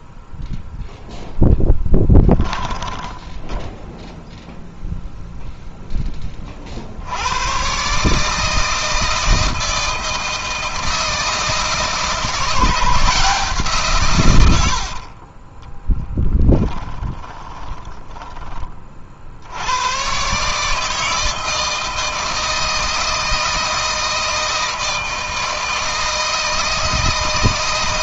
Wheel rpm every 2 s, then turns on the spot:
0, 10, 0, 70, 160, 160, 170, 50, 20, 40, 150, 160, 160, 160.
2-4 14-18